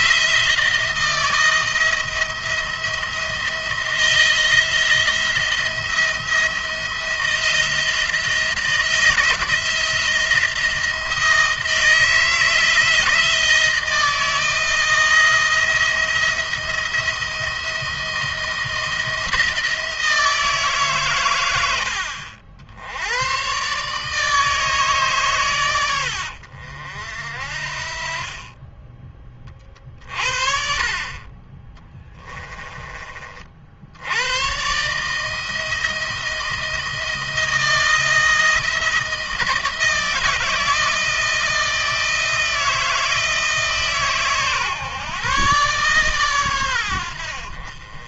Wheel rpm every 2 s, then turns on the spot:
170, 170, 170, 170, 170, 170, 170, 170, 170, 170, 140, 80, 140, 60, 20, 50, 30, 130, 170, 160, 160, 160, 130, 100.
none